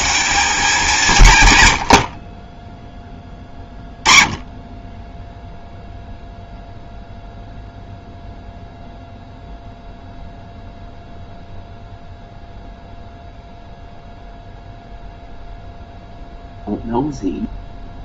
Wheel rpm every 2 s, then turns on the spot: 180, 20, 20, 0, 0, 0, 0, 0, 0.
none